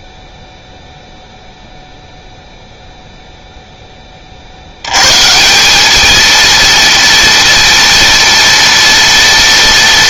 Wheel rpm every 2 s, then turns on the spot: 0, 0, 90, 230, 230.
none